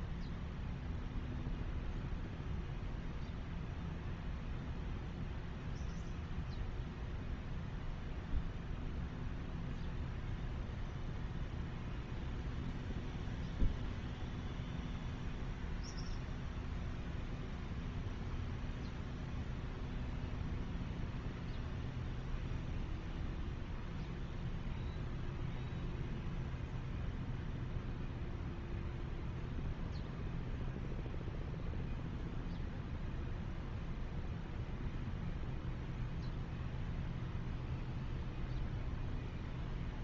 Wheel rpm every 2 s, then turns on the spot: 0, 0, 0, 0, 0, 0, 0, 0, 0, 0, 0, 0, 0, 0, 0, 0, 0, 0, 0, 0.
none